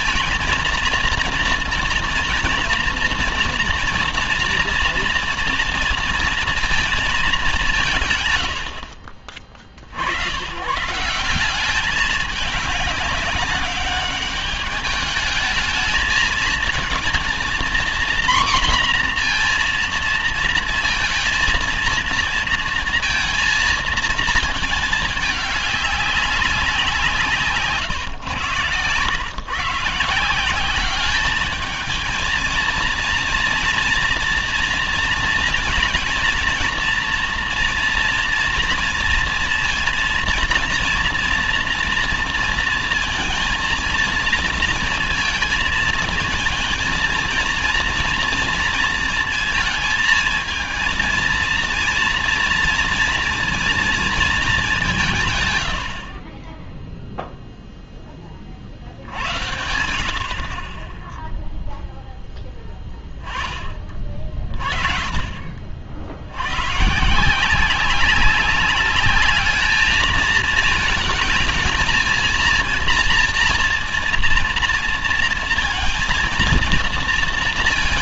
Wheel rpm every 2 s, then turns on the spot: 230, 230, 230, 230, 100, 110, 210, 210, 220, 240, 230, 230, 220, 200, 110, 180, 230, 230, 230, 230, 230, 230, 230, 230, 230, 230, 230, 210, 20, 30, 40, 10, 40, 90, 200, 220, 230, 230, 230.
none